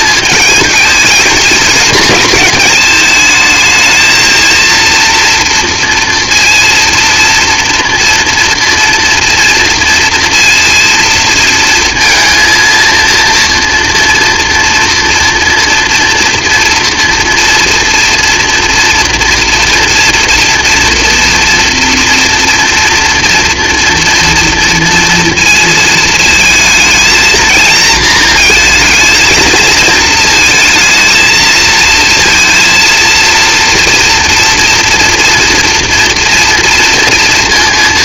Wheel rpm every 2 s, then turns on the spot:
220, 210, 230, 230, 240, 230, 230, 240, 230, 230, 230, 230, 230, 220, 220, 230, 230, 230, 230.
none